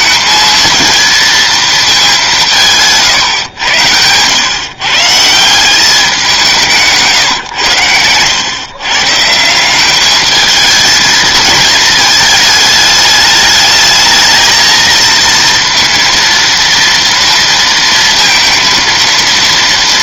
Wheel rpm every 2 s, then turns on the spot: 230, 170, 130, 170, 120, 220, 210, 220, 230, 230.
none